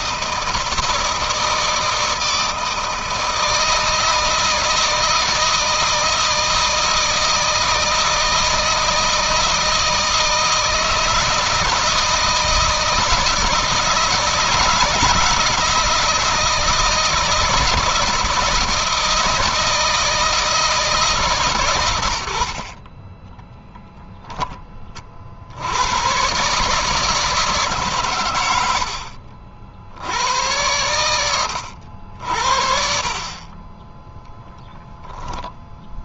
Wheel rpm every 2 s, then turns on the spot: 160, 160, 160, 160, 160, 160, 160, 160, 160, 160, 160, 50, 30, 150, 80, 100, 60, 10.
22-24